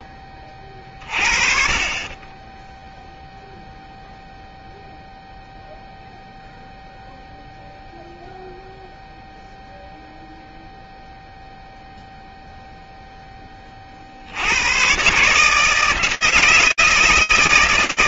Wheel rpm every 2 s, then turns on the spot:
30, 10, 0, 0, 0, 0, 0, 100, 160.
none